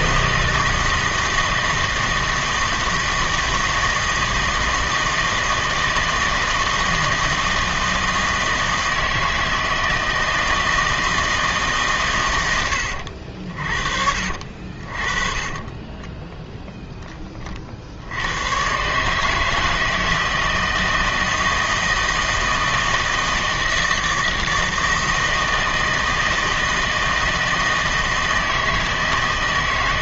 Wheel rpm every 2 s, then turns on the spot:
160, 160, 160, 160, 160, 160, 90, 50, 10, 120, 160, 160, 160, 160, 160.
none